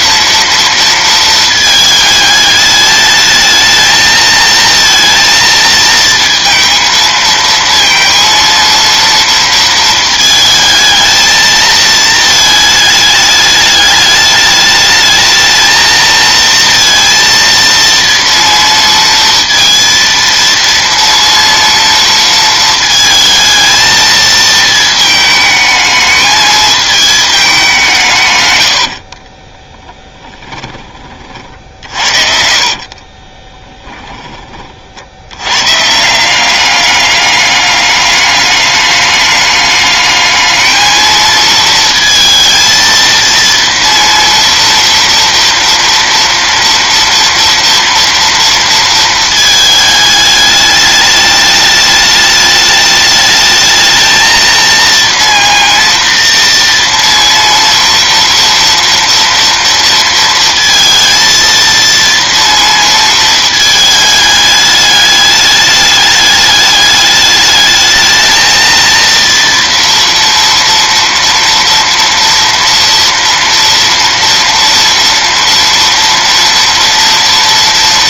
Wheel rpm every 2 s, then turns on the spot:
230, 210, 230, 230, 230, 220, 220, 210, 230, 230, 230, 230, 220, 220, 90, 40, 50, 40, 190, 210, 220, 230, 230, 230, 230, 210, 210, 230, 230, 230, 230, 230, 210, 210, 230, 230, 230, 230, 230.
28-30 32-34